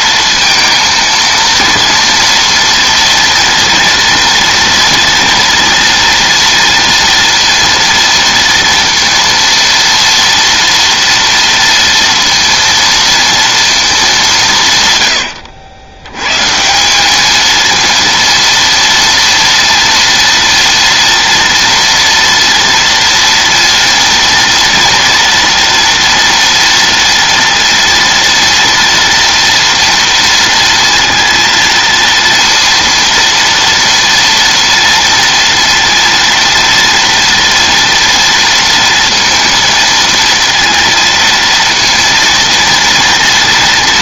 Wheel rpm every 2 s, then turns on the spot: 230, 230, 230, 230, 230, 230, 230, 130, 170, 230, 230, 230, 230, 230, 230, 230, 230, 230, 230, 230, 230, 230.
none